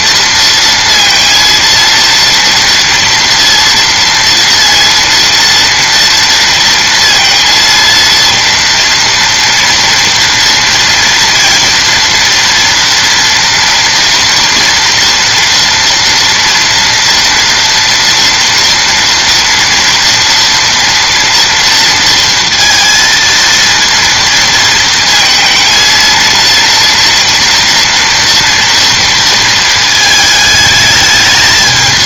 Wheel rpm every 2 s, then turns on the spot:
230, 240, 230, 230, 230, 230, 230, 230, 230, 230, 230, 230, 230, 230, 230, 220.
none